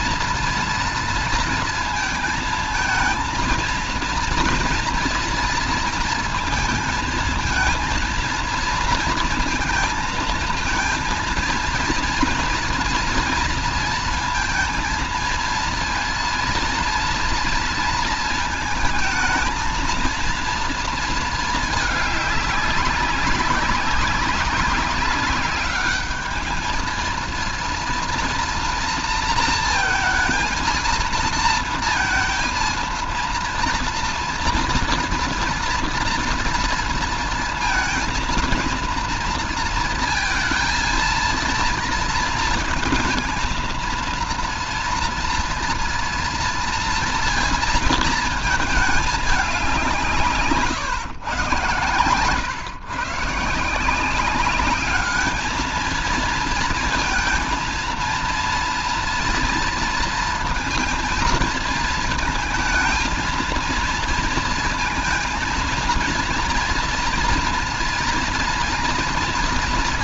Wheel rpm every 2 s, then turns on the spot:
230, 220, 230, 230, 230, 230, 230, 230, 230, 230, 230, 200, 200, 220, 230, 230, 230, 230, 230, 230, 230, 220, 230, 230, 230, 160, 140, 200, 230, 230, 230, 220, 230, 230, 230.
none